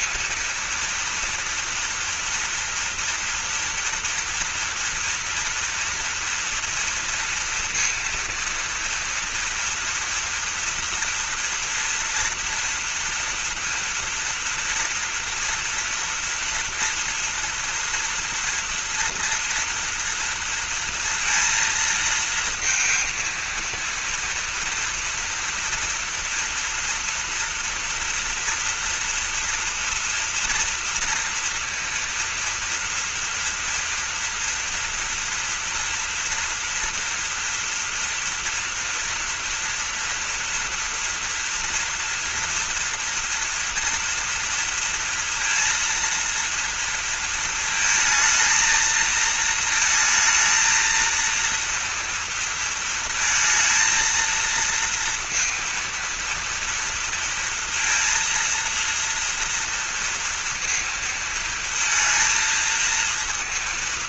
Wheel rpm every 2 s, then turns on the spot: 230, 240, 230, 230, 230, 230, 230, 240, 230, 230, 230, 230, 230, 230, 230, 230, 230, 230, 240, 230, 230, 240, 230, 230, 230, 230, 230, 230, 230, 230, 230, 230.
none